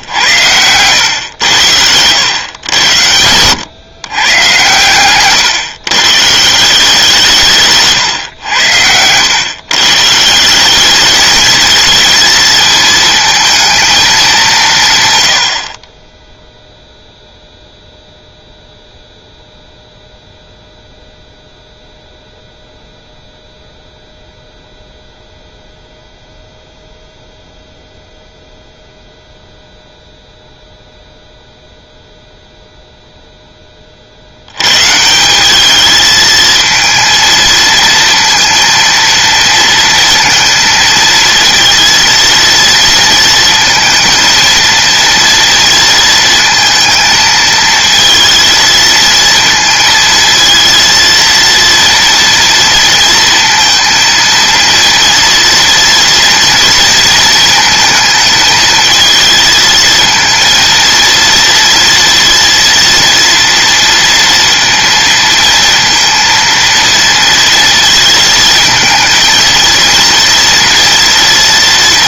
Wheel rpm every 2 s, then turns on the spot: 100, 100, 130, 170, 90, 190, 220, 160, 0, 0, 0, 0, 0, 0, 0, 0, 0, 120, 230, 230, 230, 230, 230, 220, 220, 230, 230, 230, 230, 220, 230, 230, 230, 230, 230, 230.
8-10